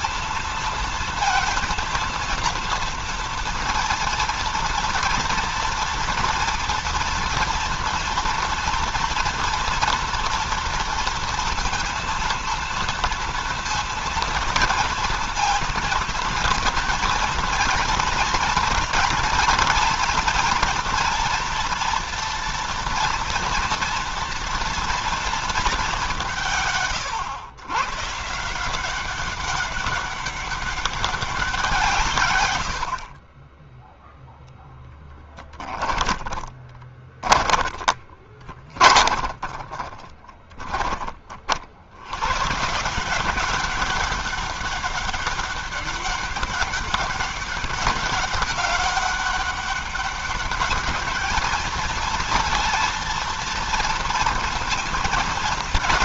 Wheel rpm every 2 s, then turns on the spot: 230, 230, 230, 230, 230, 230, 230, 230, 230, 230, 230, 230, 240, 160, 170, 200, 100, 10, 20, 20, 20, 130, 200, 200, 200, 200, 230, 230.
36-42